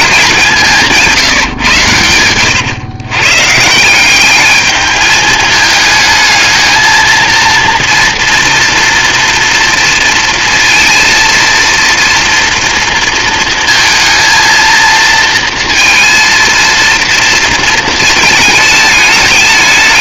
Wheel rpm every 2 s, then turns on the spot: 170, 120, 210, 220, 230, 230, 230, 230, 230, 220.
none